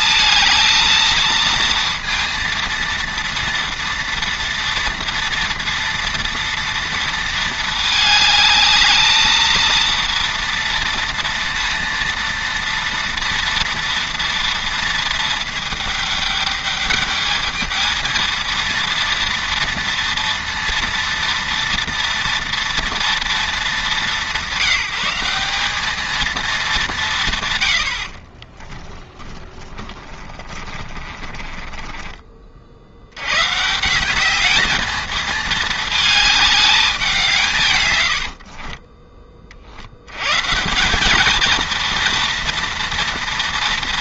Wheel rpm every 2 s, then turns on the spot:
230, 230, 230, 230, 220, 230, 230, 230, 210, 230, 230, 230, 170, 200, 20, 30, 50, 210, 210, 40, 180, 230.
28-32 38-40